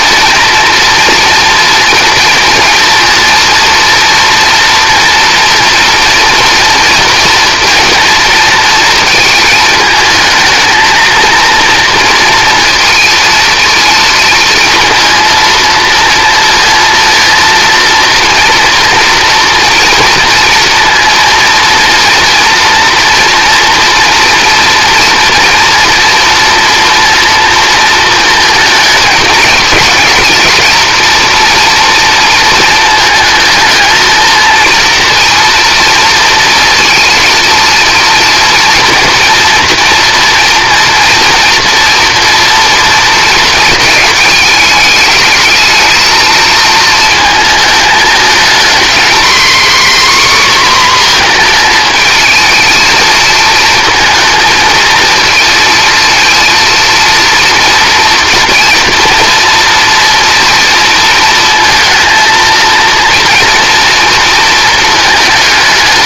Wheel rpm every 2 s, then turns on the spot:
230, 240, 230, 230, 230, 230, 230, 230, 230, 230, 230, 230, 230, 230, 220, 230, 220, 240, 230, 230, 230, 230, 210, 220, 240, 250, 220, 220, 230, 230, 230, 230, 220.
none